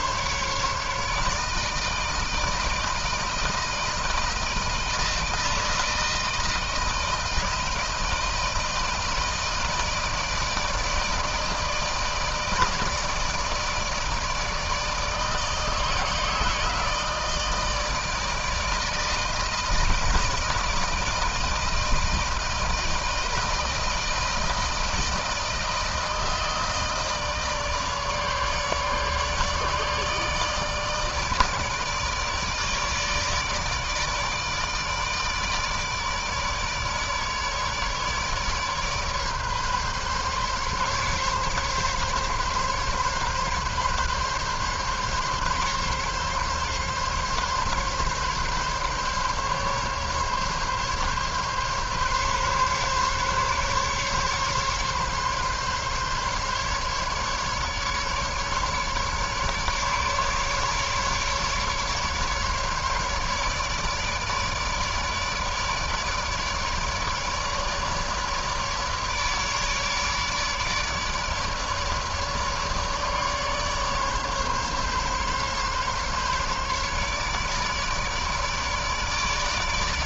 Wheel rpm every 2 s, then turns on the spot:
150, 160, 160, 170, 160, 160, 160, 160, 160, 160, 160, 160, 160, 160, 150, 150, 150, 150, 150, 150, 140, 140, 140, 140, 140, 140, 140, 140, 140, 150, 150, 150, 150, 150, 150, 150, 140, 140, 140, 150.
none